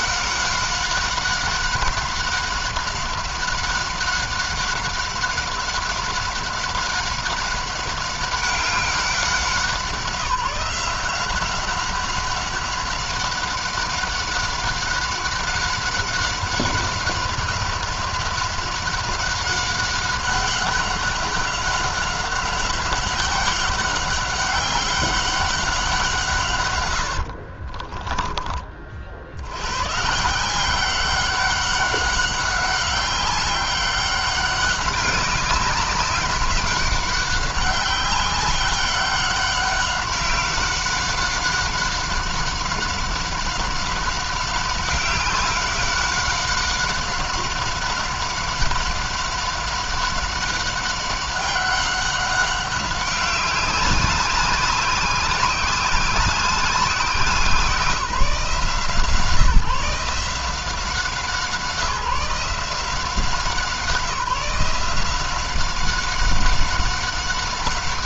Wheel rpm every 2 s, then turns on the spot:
190, 190, 190, 190, 190, 180, 190, 190, 190, 190, 200, 190, 190, 130, 30, 170, 190, 190, 190, 190, 190, 190, 190, 190, 200, 190, 190, 190, 190, 170, 160, 170, 180, 190.
26-28